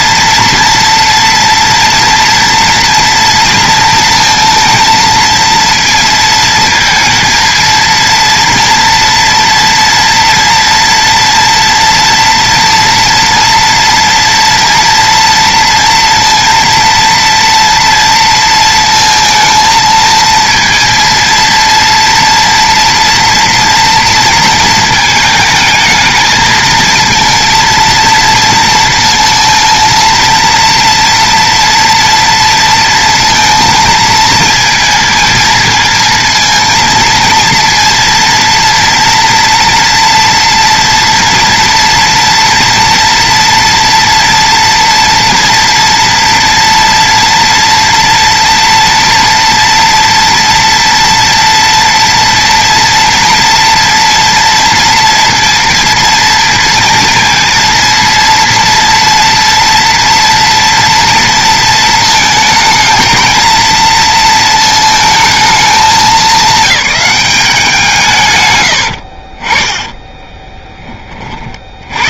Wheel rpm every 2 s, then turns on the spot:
230, 230, 230, 230, 230, 230, 230, 230, 230, 230, 230, 230, 220, 220, 230, 230, 230, 230, 230, 230, 240, 230, 230, 240, 240, 230, 230, 230, 230, 230, 230, 220, 230, 210, 100, 10.
68-70